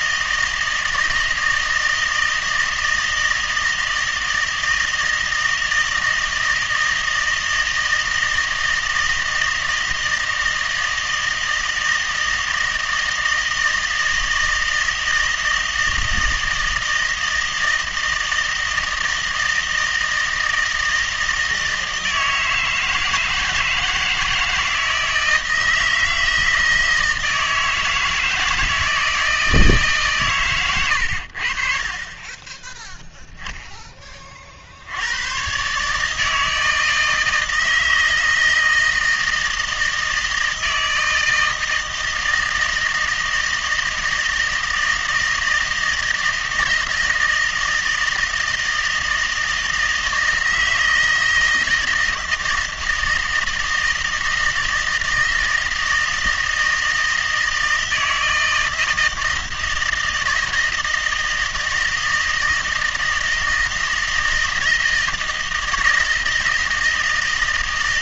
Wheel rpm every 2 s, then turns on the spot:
160, 160, 160, 160, 160, 160, 160, 160, 160, 160, 160, 160, 160, 160, 160, 110, 10, 60, 160, 160, 160, 160, 160, 160, 160, 160, 160, 160, 160, 160, 160, 160, 160, 160.
none